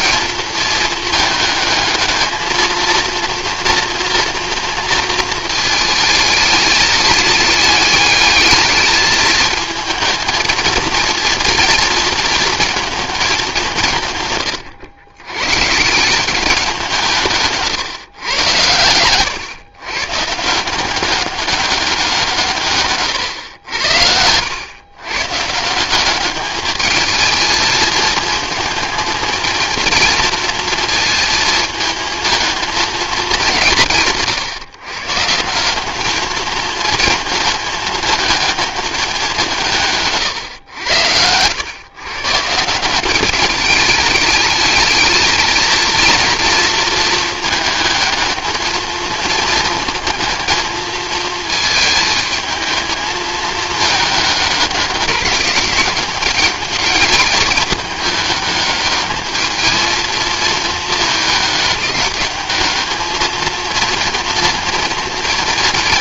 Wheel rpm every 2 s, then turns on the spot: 220, 220, 230, 210, 210, 220, 230, 120, 190, 100, 170, 140, 110, 210, 230, 230, 220, 130, 220, 220, 120, 160, 220, 230, 220, 230, 220, 210, 210, 210, 220, 210, 230.
none